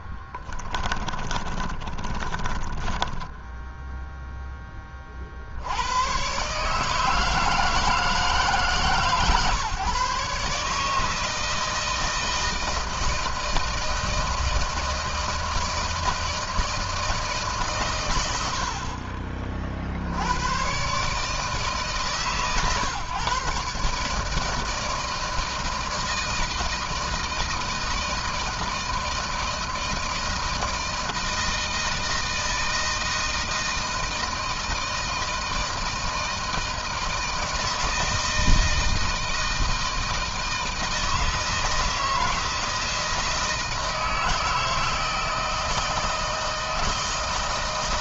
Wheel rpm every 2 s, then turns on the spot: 20, 10, 20, 150, 150, 150, 160, 160, 160, 60, 130, 140, 160, 160, 160, 170, 160, 160, 160, 160, 160, 160, 160, 160.
0-4